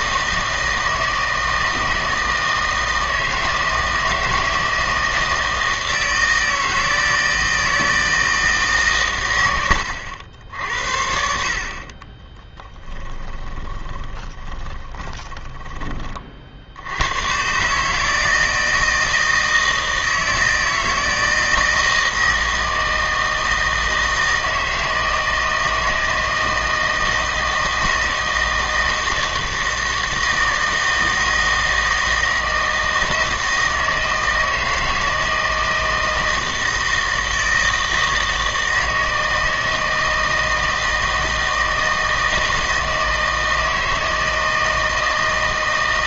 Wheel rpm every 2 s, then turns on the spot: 160, 160, 160, 160, 140, 60, 10, 20, 80, 160, 160, 160, 160, 160, 160, 160, 160, 160, 160, 160, 160, 160, 160.
12-16